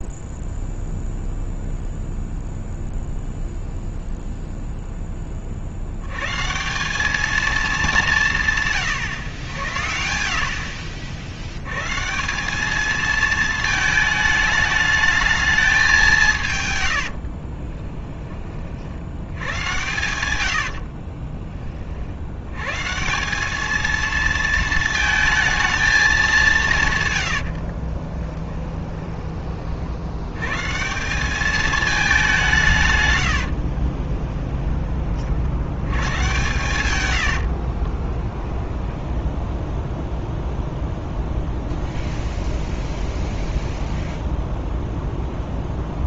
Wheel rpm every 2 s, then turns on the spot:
0, 0, 0, 180, 140, 50, 210, 220, 100, 40, 80, 120, 220, 150, 20, 160, 150, 10, 120, 10, 0, 0, 0.
20-22 28-30 38-40